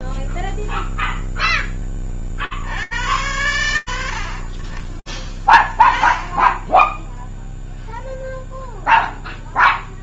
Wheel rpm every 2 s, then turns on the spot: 0, 60, 20, 0, 0.
none